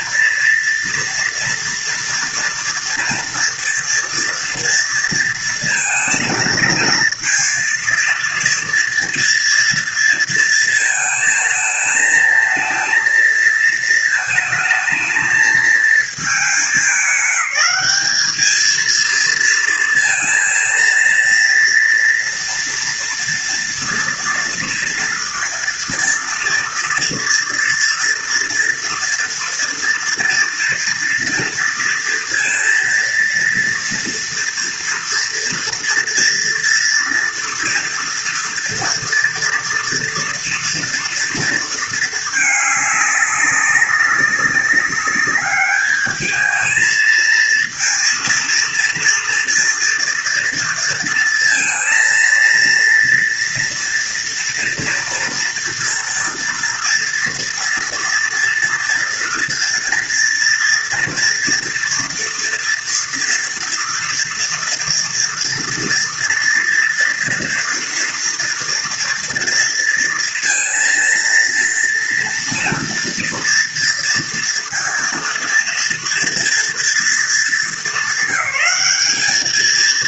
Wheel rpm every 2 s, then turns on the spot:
230, 230, 230, 230, 240, 230, 230, 220, 200, 230, 230, 230, 230, 230, 230, 230, 230, 230, 230, 230, 230, 200, 200, 220, 230, 230, 230, 230, 230, 230, 230, 230, 230, 230, 230, 230, 230, 230, 220, 200.
none